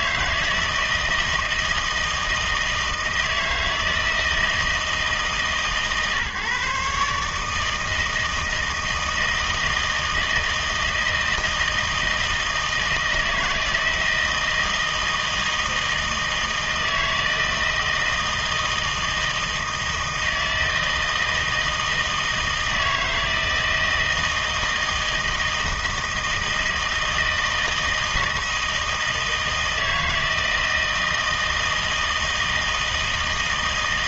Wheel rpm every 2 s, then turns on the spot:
160, 160, 160, 140, 160, 160, 160, 160, 160, 160, 160, 160, 160, 160, 160, 160, 160.
none